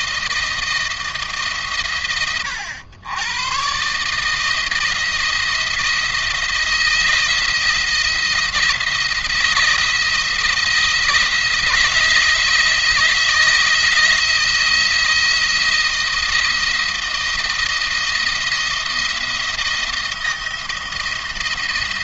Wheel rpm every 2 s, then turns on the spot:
170, 100, 160, 170, 170, 170, 160, 170, 170, 170, 170.
none